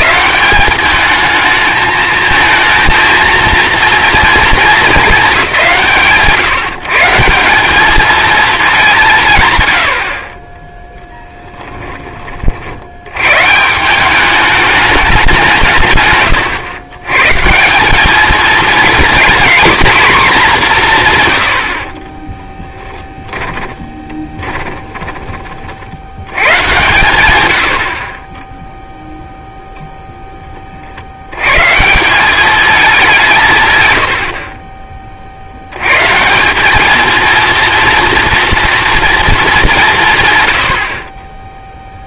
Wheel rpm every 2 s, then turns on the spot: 200, 220, 220, 130, 220, 10, 60, 210, 120, 230, 200, 10, 20, 110, 0, 20, 210, 40, 210, 240, 90.
22-26